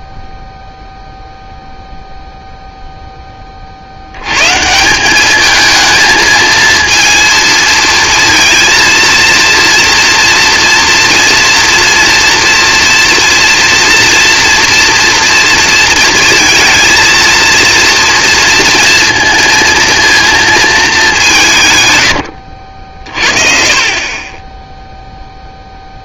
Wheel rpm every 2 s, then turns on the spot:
0, 0, 170, 230, 230, 230, 230, 230, 230, 230, 210, 60, 30.
none